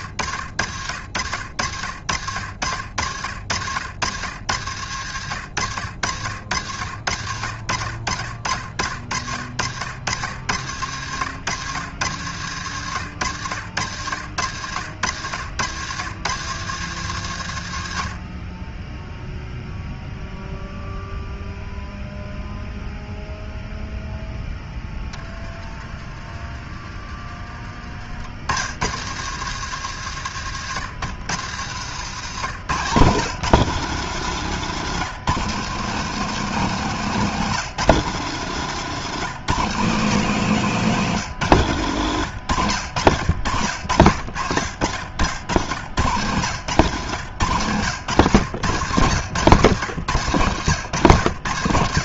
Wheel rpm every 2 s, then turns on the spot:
70, 60, 90, 80, 60, 90, 100, 90, 120, 30, 0, 0, 10, 30, 80, 110, 140, 170, 180, 160, 180, 110, 80, 120, 120, 120.
34-36 40-42 46-50